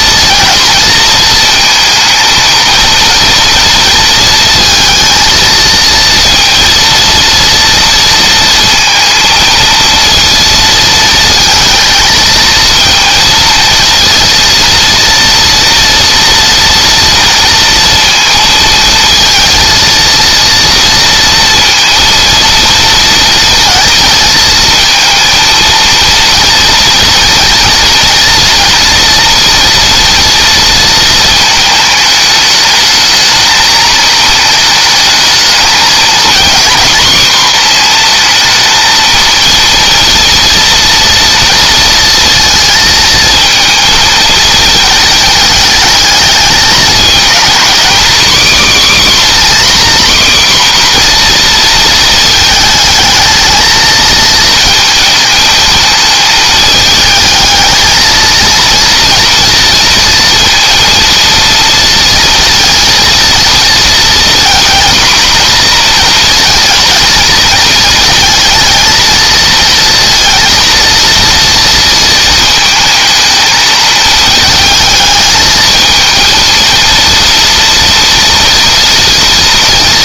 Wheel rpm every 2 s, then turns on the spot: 230, 230, 230, 230, 220, 230, 230, 230, 230, 230, 230, 230, 230, 230, 240, 230, 220, 220, 230, 230, 230, 230, 220, 220, 280, 250, 220, 220, 220, 230, 230, 230, 240, 230, 230, 230, 220, 220, 230, 230.
none